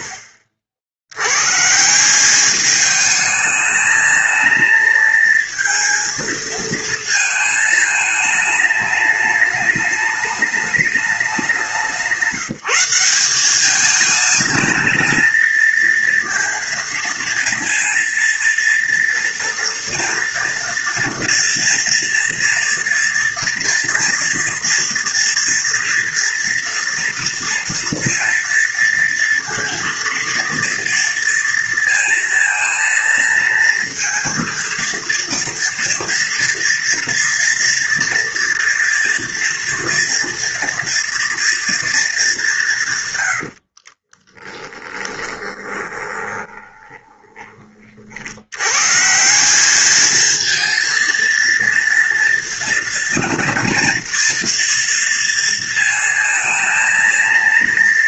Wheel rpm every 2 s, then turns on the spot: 60, 220, 230, 220, 210, 200, 190, 230, 230, 230, 240, 230, 230, 230, 230, 230, 230, 230, 230, 230, 230, 110, 10, 20, 150, 230, 230, 230, 230.
42-48